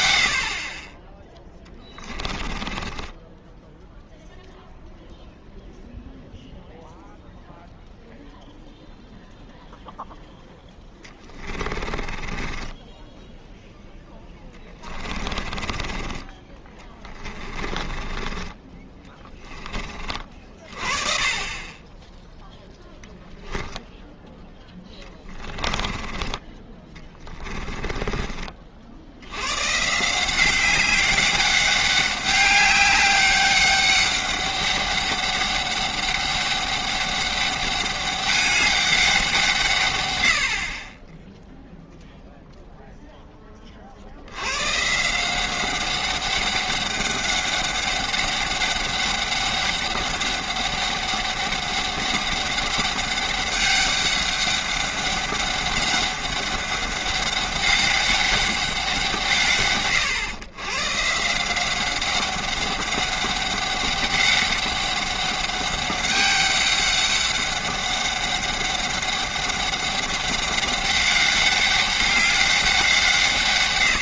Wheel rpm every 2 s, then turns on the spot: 60, 20, 0, 0, 0, 0, 20, 20, 20, 30, 40, 10, 10, 20, 60, 190, 200, 200, 200, 200, 30, 0, 150, 200, 200, 200, 200, 200, 200, 170, 140, 190, 190, 200, 200, 200, 180.
2-4 12-16 18-20 24-28